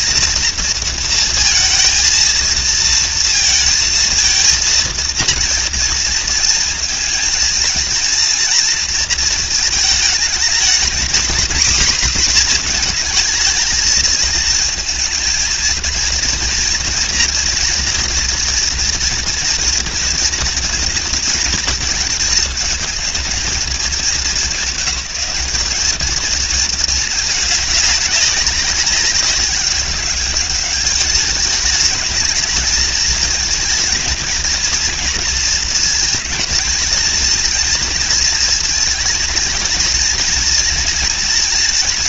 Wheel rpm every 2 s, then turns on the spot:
230, 230, 230, 230, 230, 230, 230, 230, 240, 230, 230, 220, 200, 220, 190, 210, 220, 230, 230, 220, 230.
none